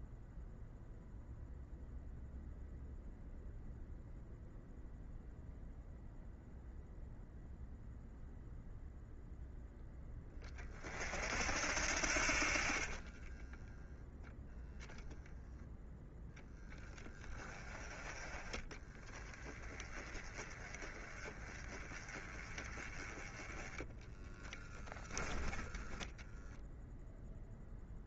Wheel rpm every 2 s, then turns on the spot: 0, 0, 0, 0, 0, 30, 30, 20, 0, 20, 20, 20, 10, 0.
12-16